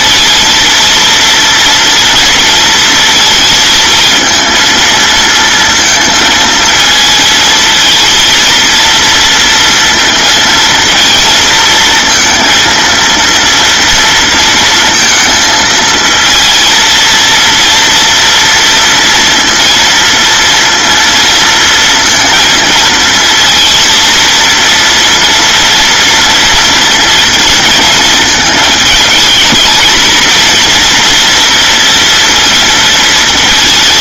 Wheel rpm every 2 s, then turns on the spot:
230, 230, 230, 220, 230, 230, 230, 230, 230, 230, 230, 230, 230, 230, 220, 230, 230.
none